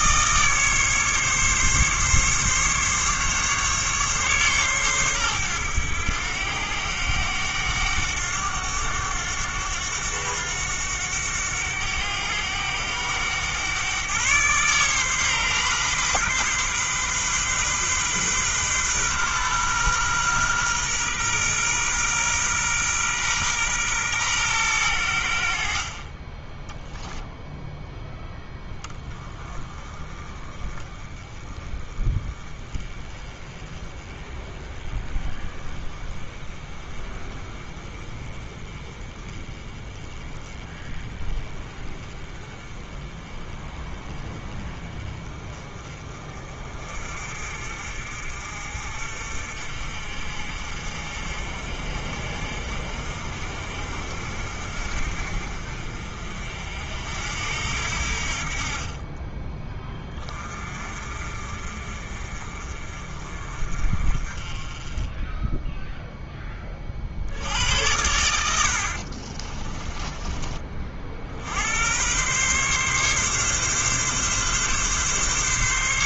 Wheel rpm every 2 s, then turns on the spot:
150, 140, 120, 90, 100, 100, 100, 130, 130, 130, 120, 120, 90, 0, 20, 20, 20, 20, 20, 20, 20, 20, 20, 40, 50, 50, 50, 50, 60, 30, 40, 40, 20, 40, 50, 40, 140, 140.
68-70